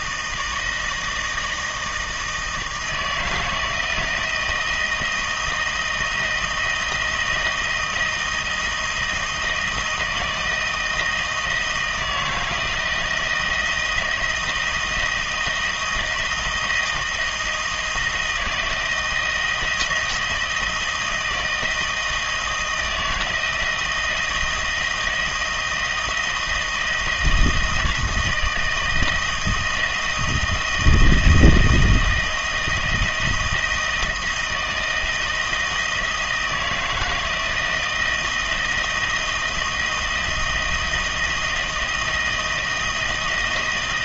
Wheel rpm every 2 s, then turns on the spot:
160, 160, 160, 160, 170, 160, 160, 170, 160, 160, 160, 160, 160, 160, 160, 160, 160, 160, 160, 160, 170, 170.
none